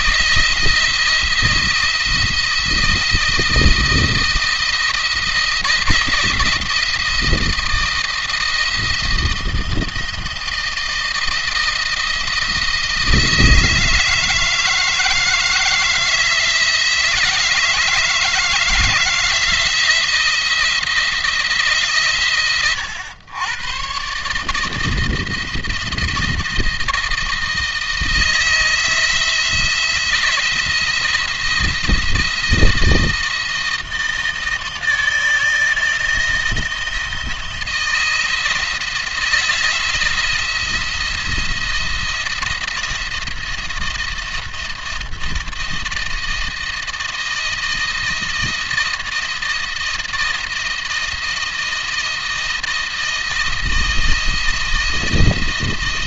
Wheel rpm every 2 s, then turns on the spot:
170, 170, 170, 170, 170, 170, 170, 160, 160, 160, 170, 120, 160, 160, 160, 170, 160, 160, 170, 170, 160, 170, 170, 170, 160, 160, 160, 170.
none